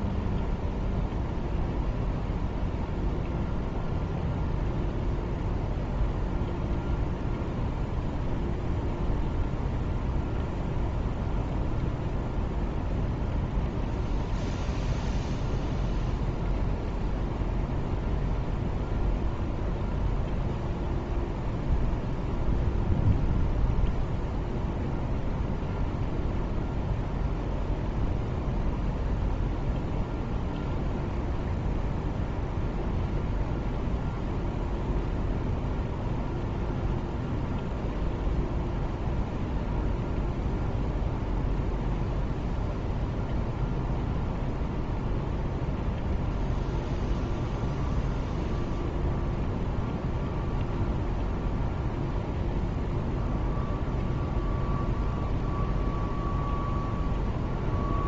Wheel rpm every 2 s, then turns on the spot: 0, 0, 0, 0, 0, 0, 0, 0, 0, 0, 0, 0, 0, 0, 0, 0, 0, 0, 0, 0, 0, 0, 0, 0, 0, 0, 0, 0, 0.
none